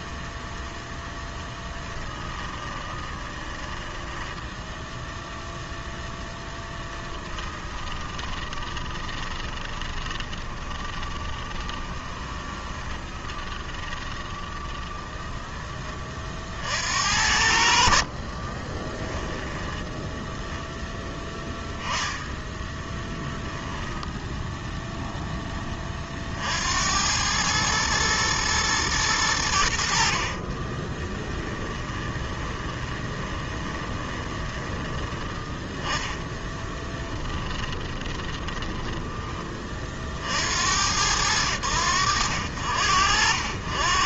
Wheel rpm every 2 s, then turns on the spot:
0, 20, 10, 10, 20, 20, 20, 20, 50, 30, 10, 30, 10, 70, 110, 30, 20, 20, 10, 20, 70, 70.
2-16 18-20 22-24 30-40